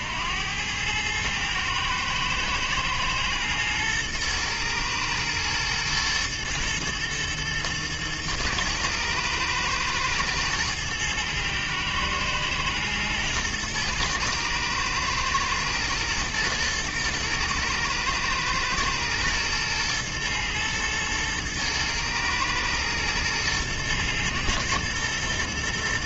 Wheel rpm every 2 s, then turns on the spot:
110, 110, 120, 110, 110, 110, 120, 110, 110, 120, 110, 110, 110.
none